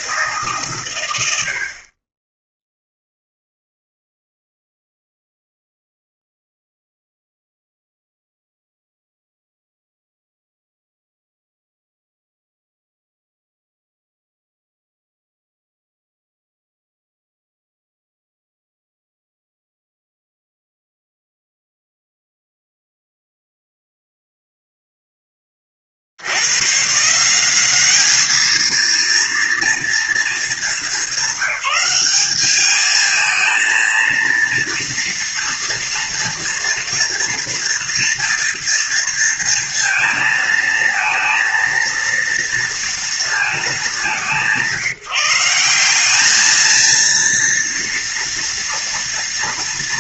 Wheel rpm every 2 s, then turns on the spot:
140, 10, 0, 0, 0, 0, 0, 0, 0, 0, 0, 0, 0, 120, 220, 220, 210, 230, 230, 230, 230, 230, 180, 220, 230.
none